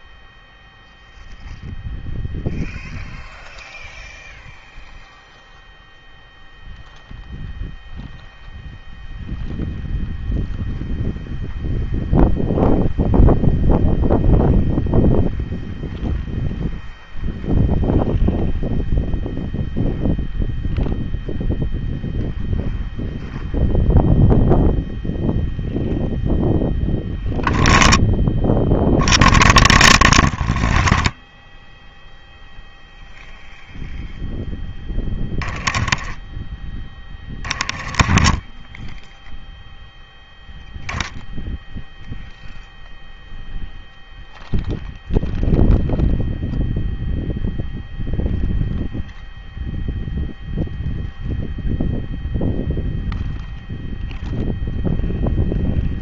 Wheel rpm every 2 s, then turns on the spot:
0, 0, 0, 0, 0, 0, 0, 0, 0, 0, 0, 0, 0, 0, 0, 0, 0, 10, 10, 10, 0, 0, 0, 0, 0, 0, 0, 0.
none